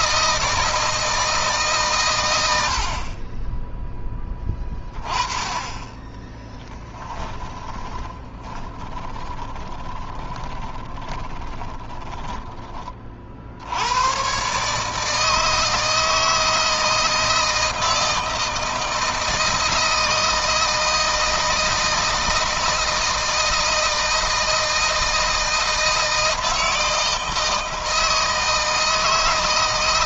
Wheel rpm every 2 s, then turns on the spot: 160, 70, 20, 10, 20, 20, 20, 150, 160, 160, 160, 160, 160, 160, 160.
6-12